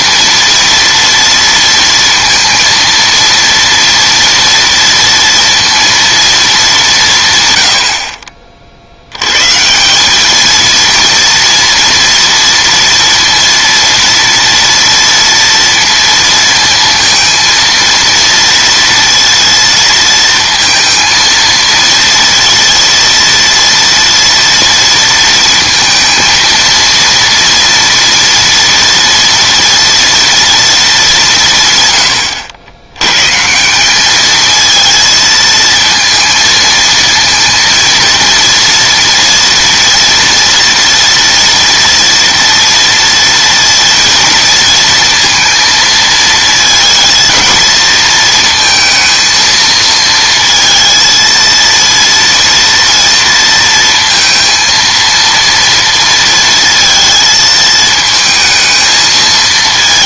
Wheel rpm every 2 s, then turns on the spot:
230, 230, 230, 200, 50, 230, 230, 230, 230, 230, 230, 230, 230, 230, 230, 230, 90, 220, 230, 230, 240, 230, 230, 230, 230, 230, 230, 230, 230, 220.
none